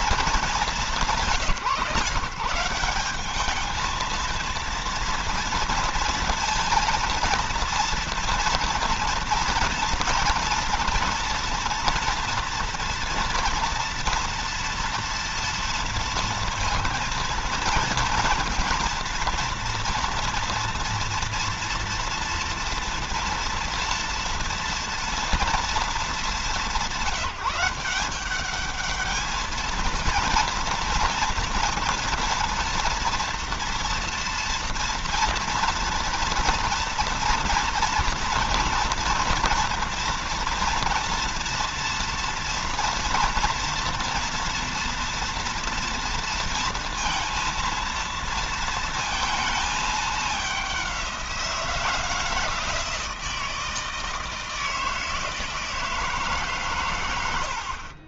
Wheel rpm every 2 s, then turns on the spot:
190, 200, 230, 230, 230, 240, 230, 230, 240, 230, 230, 230, 230, 200, 220, 240, 230, 230, 230, 230, 230, 230, 230, 230, 230, 180, 160, 160, 100.
none